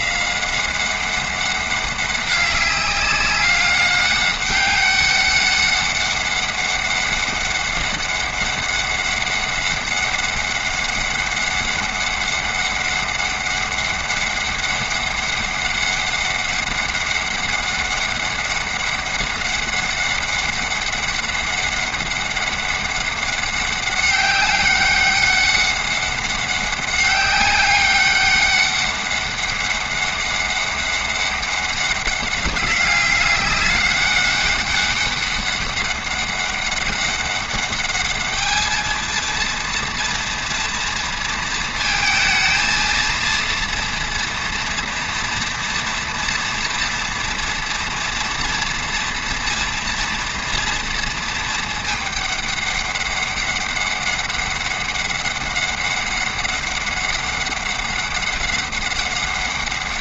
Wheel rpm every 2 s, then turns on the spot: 190, 200, 200, 200, 200, 200, 200, 200, 200, 200, 200, 200, 200, 200, 200, 200, 200, 200, 200, 220, 230, 230, 240, 230, 240, 230, 200, 200, 200, 200.
none